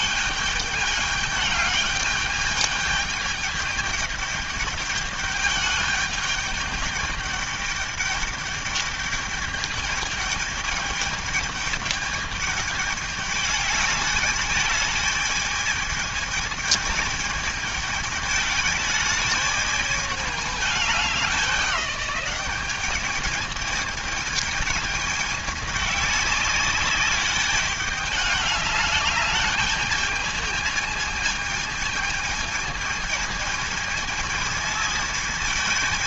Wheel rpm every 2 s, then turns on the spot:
210, 210, 210, 210, 210, 210, 210, 210, 220, 210, 210, 210, 210, 200, 210, 220, 220, 220.
none